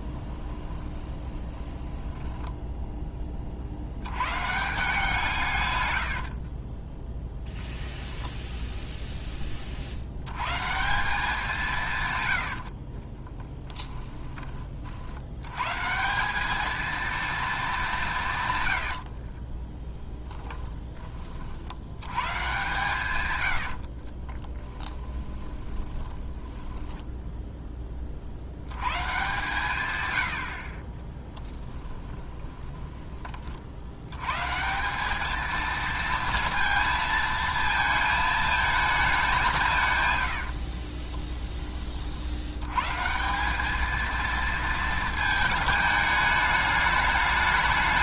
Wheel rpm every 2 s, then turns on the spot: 20, 10, 160, 20, 0, 160, 40, 50, 220, 80, 20, 140, 10, 10, 110, 30, 20, 180, 220, 210, 30, 120, 220, 210.
0-4 6-8 12-14 18-20 24-28 32-34 40-42